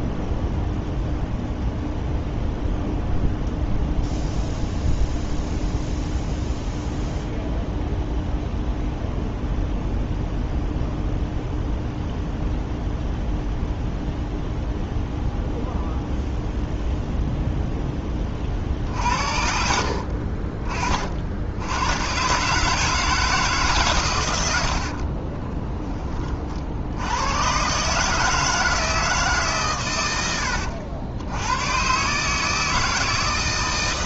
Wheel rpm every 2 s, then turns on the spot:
0, 0, 0, 0, 0, 0, 0, 0, 0, 40, 40, 140, 80, 50, 160, 90, 160.
none